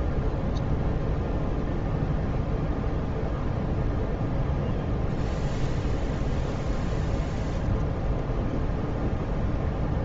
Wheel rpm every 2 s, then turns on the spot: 0, 0, 0, 0, 0.
none